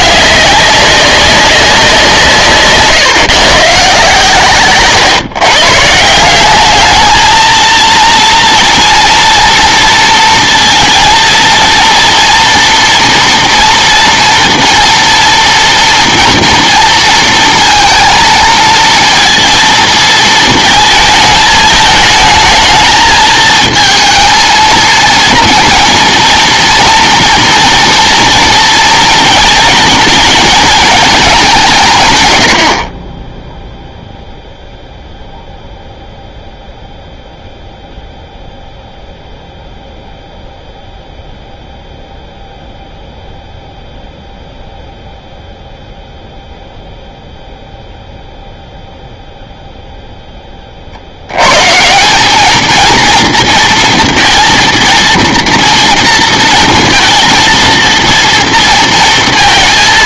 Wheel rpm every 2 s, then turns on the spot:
200, 150, 140, 200, 230, 230, 240, 230, 230, 230, 220, 220, 230, 230, 230, 220, 80, 0, 0, 0, 0, 0, 0, 0, 0, 30, 220, 230, 230, 230.
none